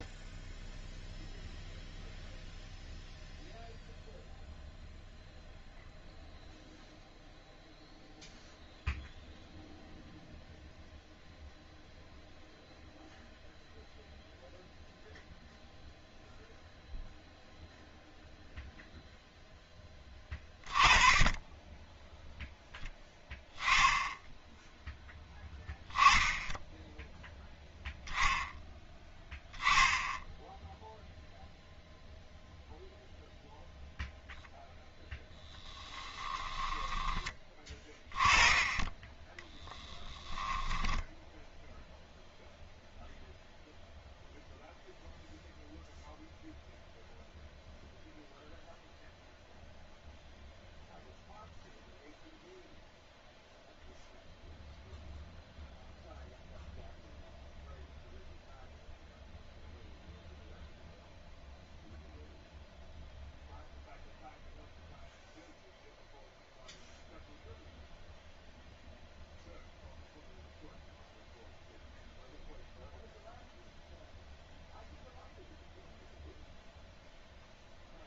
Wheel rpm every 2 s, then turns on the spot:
0, 0, 0, 0, 0, 0, 0, 0, 0, 0, 20, 0, 0, 0, 10, 0, 0, 0, 10, 20, 10, 0, 0, 0, 0, 0, 0, 0, 0, 0, 0, 0, 0, 0, 0, 0, 0, 0, 0.
40-42